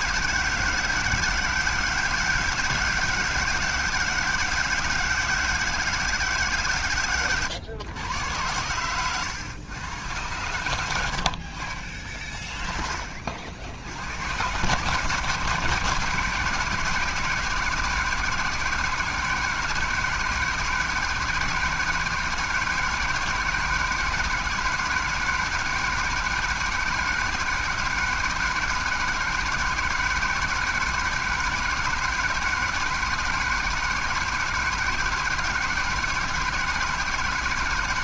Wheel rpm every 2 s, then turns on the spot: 160, 160, 160, 130, 100, 100, 30, 130, 150, 150, 160, 170, 160, 160, 160, 160, 160, 160, 160.
none